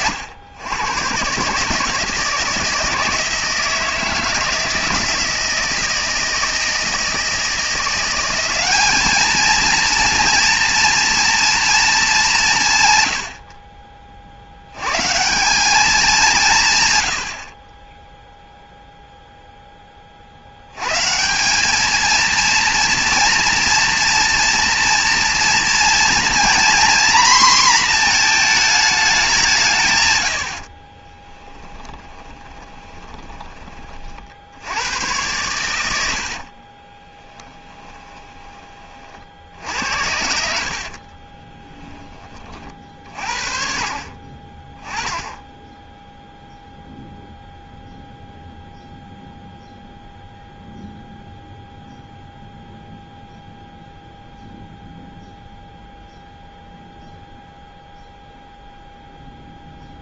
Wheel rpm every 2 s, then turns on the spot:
110, 160, 160, 160, 200, 230, 140, 90, 140, 0, 110, 230, 230, 250, 220, 50, 10, 90, 30, 30, 60, 40, 10, 0, 0, 0, 0, 0, 0, 0.
30-34 36-38 40-42